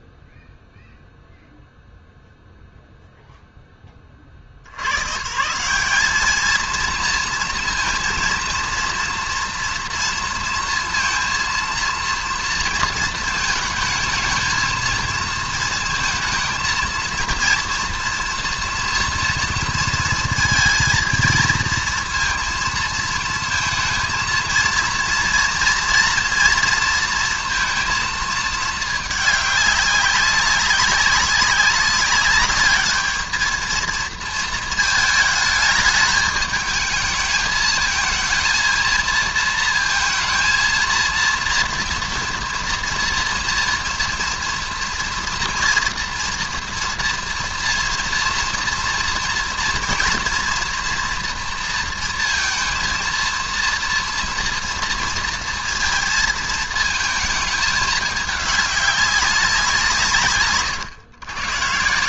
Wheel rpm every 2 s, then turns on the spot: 0, 0, 90, 220, 230, 230, 230, 220, 230, 230, 230, 230, 230, 230, 220, 190, 210, 220, 220, 230, 230, 230, 230, 230, 230, 230, 230, 230, 220, 200, 130.
none